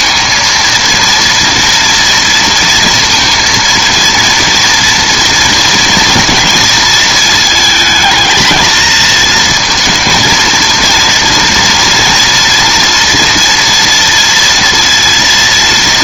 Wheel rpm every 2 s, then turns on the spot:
230, 230, 240, 230, 220, 230, 230, 230.
none